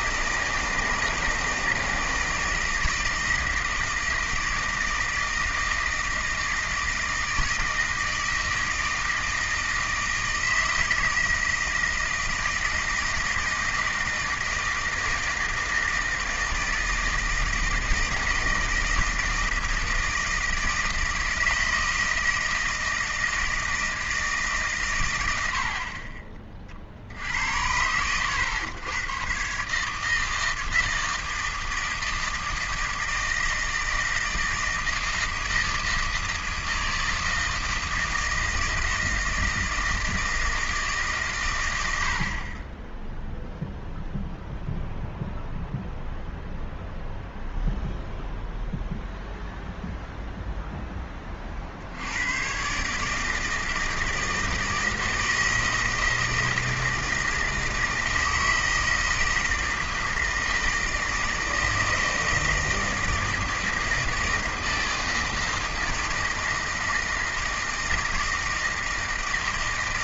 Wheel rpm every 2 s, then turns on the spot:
160, 160, 160, 160, 160, 160, 160, 160, 160, 160, 160, 160, 140, 40, 110, 160, 160, 160, 160, 160, 160, 20, 0, 0, 0, 0, 130, 160, 160, 160, 160, 160, 160, 160, 160.
none